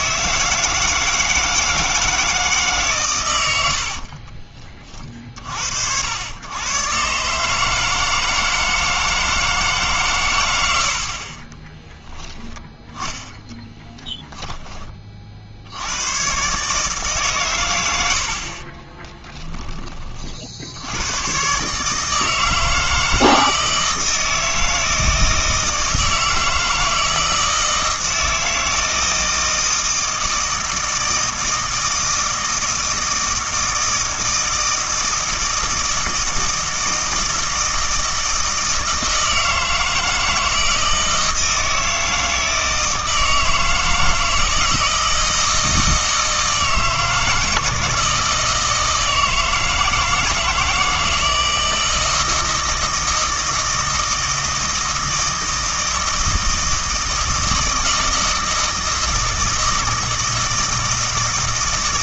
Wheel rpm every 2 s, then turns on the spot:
160, 150, 30, 110, 160, 100, 10, 20, 140, 30, 70, 160, 160, 160, 160, 160, 160, 160, 160, 160, 160, 160, 160, 160, 160, 160, 160, 160, 160, 160, 160.
12-14 18-20